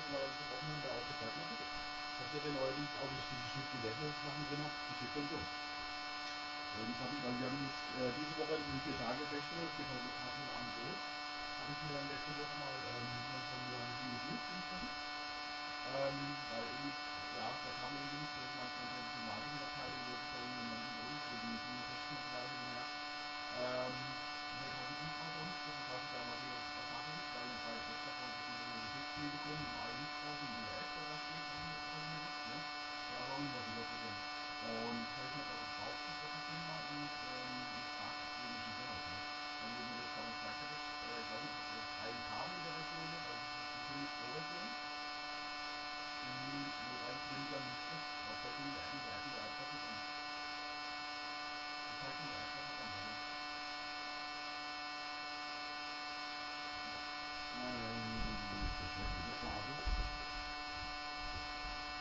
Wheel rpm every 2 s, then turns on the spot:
0, 0, 0, 0, 0, 0, 0, 0, 0, 0, 0, 0, 0, 0, 0, 0, 0, 0, 0, 0, 0, 0, 0, 0, 0, 0, 0, 0, 0, 0, 0.
none